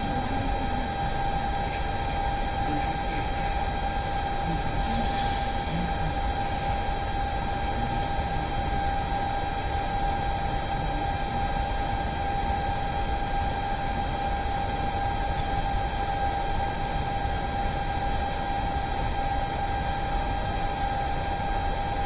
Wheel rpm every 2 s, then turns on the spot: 0, 0, 0, 0, 0, 0, 0, 0, 0, 0, 0.
none